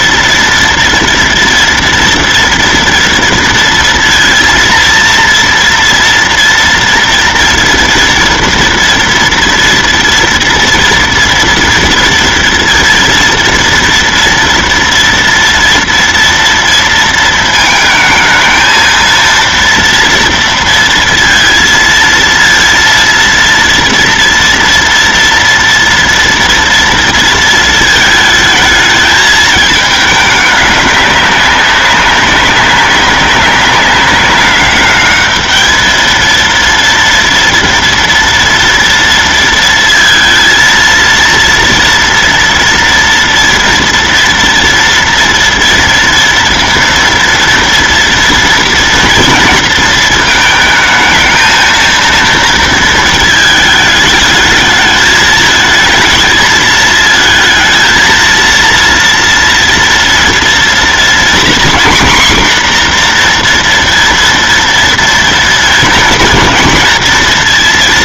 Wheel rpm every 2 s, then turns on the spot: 230, 230, 230, 230, 230, 230, 230, 230, 230, 220, 230, 230, 230, 230, 210, 210, 200, 200, 230, 230, 230, 230, 230, 230, 230, 220, 230, 220, 220, 230, 230, 250, 230, 230.
none